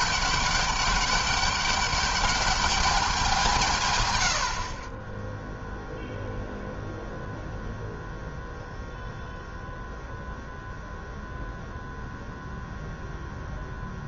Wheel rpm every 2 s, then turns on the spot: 200, 200, 40, 0, 0, 0, 0.
none